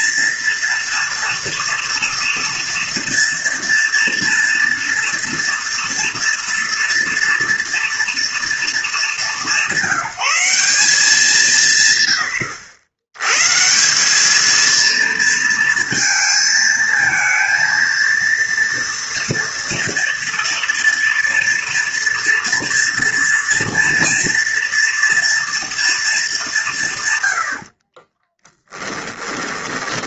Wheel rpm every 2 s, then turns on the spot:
230, 230, 230, 230, 200, 180, 110, 230, 220, 230, 240, 230, 230, 100, 10.
28-30